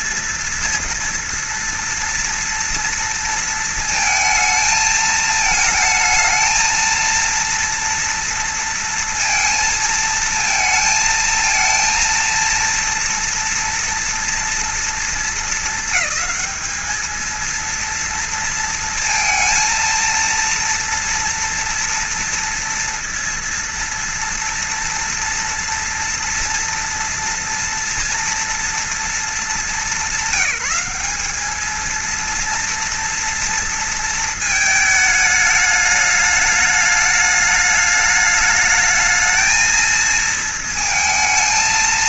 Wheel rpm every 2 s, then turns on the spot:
230, 230, 220, 220, 230, 220, 230, 230, 220, 230, 230, 230, 230, 230, 230, 200, 230, 220, 210, 210, 230.
none